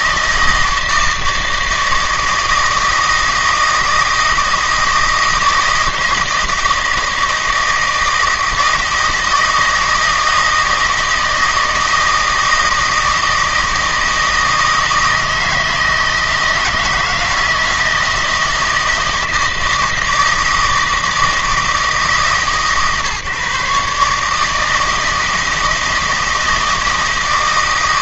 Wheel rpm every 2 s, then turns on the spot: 160, 160, 160, 160, 160, 160, 160, 160, 160, 160, 160, 140, 160, 160.
none